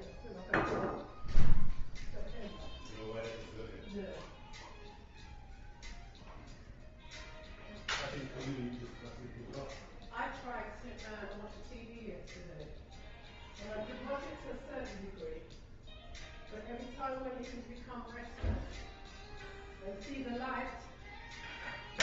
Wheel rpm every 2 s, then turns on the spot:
0, 0, 0, 0, 0, 0, 0, 0, 0, 0, 0.
none